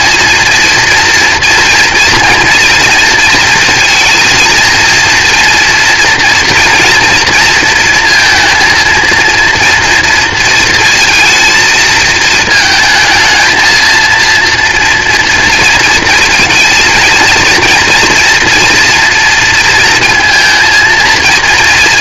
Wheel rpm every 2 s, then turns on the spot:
230, 230, 230, 240, 230, 230, 230, 230, 230, 230, 230.
none